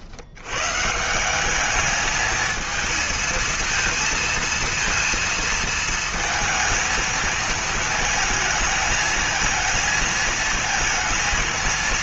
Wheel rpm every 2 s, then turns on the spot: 100, 220, 230, 230, 220, 220.
none